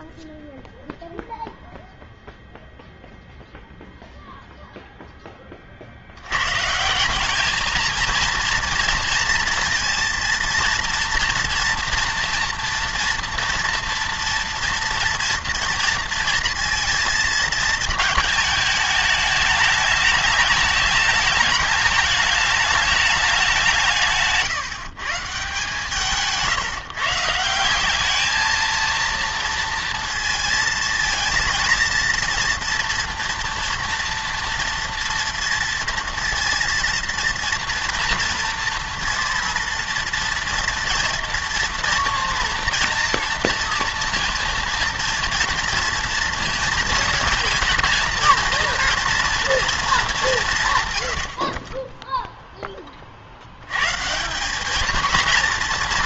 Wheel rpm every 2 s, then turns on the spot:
0, 0, 0, 130, 230, 230, 230, 230, 230, 220, 210, 210, 160, 160, 220, 230, 230, 230, 230, 230, 240, 230, 230, 230, 240, 140, 10, 200.
none